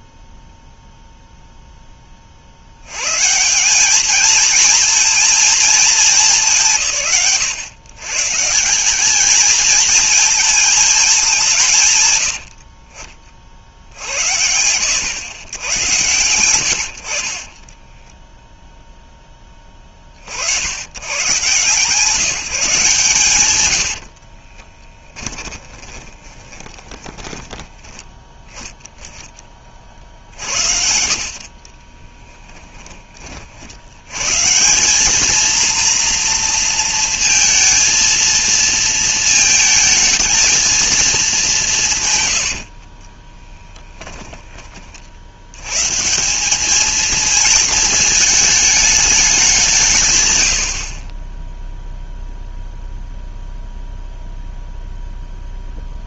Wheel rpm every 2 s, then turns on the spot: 0, 90, 230, 160, 190, 220, 40, 90, 70, 0, 100, 150, 20, 20, 10, 70, 10, 190, 230, 230, 220, 50, 40, 220, 210, 50, 0, 0.
24-28 42-44 50-52